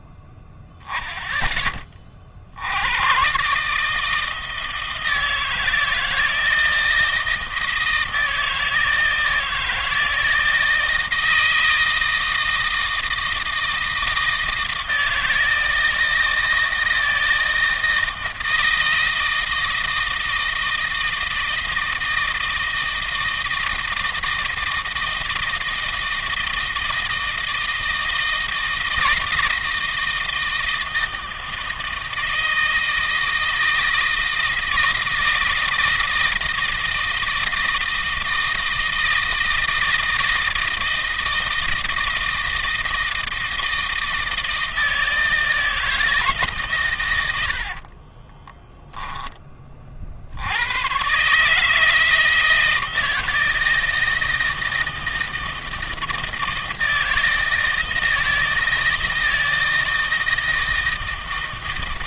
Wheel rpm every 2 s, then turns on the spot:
10, 120, 160, 160, 160, 160, 160, 160, 160, 160, 160, 160, 160, 160, 160, 160, 160, 160, 160, 160, 160, 160, 160, 120, 10, 130, 160, 160, 160, 160, 160.
46-48